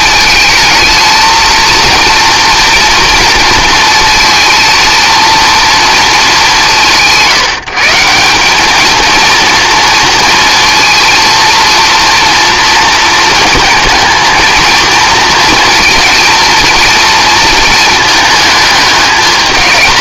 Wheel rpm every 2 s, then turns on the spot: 220, 230, 230, 180, 200, 230, 230, 230, 230, 210.
none